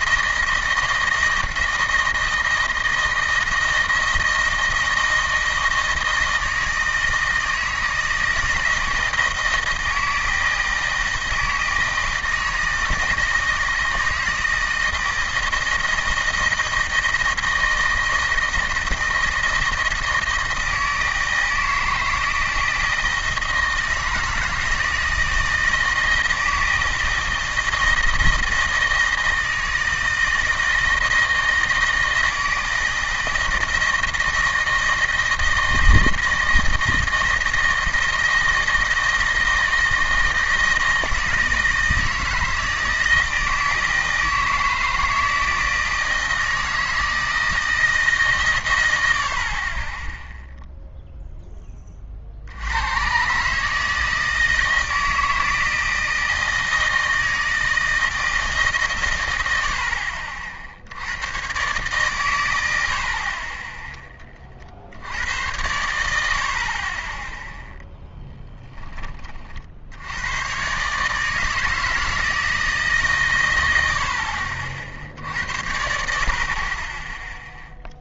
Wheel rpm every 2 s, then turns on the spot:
160, 160, 160, 160, 160, 160, 160, 160, 160, 160, 160, 160, 160, 160, 160, 160, 160, 160, 160, 160, 160, 160, 160, 160, 110, 0, 70, 160, 160, 150, 70, 90, 30, 60, 10, 120, 160, 50, 30.
none